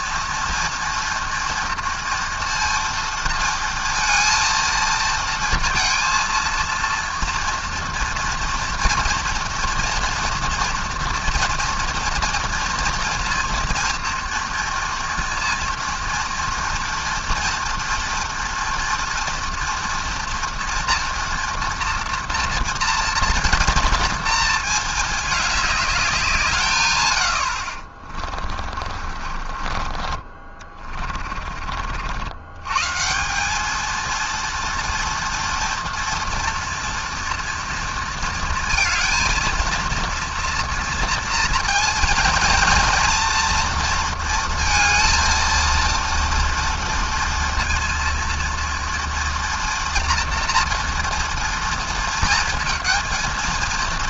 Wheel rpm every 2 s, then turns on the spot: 230, 230, 230, 230, 230, 230, 230, 230, 240, 240, 230, 230, 220, 130, 40, 30, 150, 230, 230, 230, 230, 230, 230, 230, 230, 230, 230.
28-32